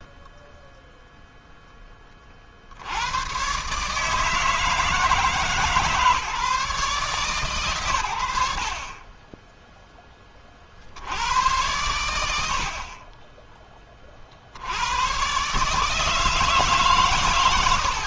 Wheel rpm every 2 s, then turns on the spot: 0, 100, 160, 130, 20, 80, 30, 120, 120.
none